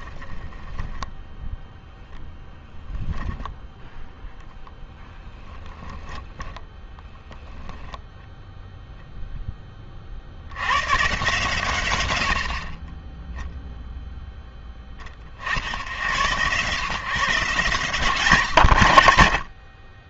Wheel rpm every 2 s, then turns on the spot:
0, 0, 10, 10, 10, 130, 0, 70, 150, 40.
4-6